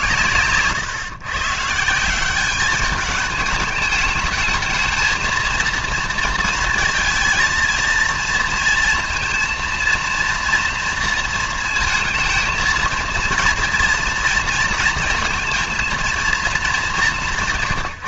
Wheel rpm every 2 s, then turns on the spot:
130, 200, 220, 230, 230, 230, 220, 230, 220.
none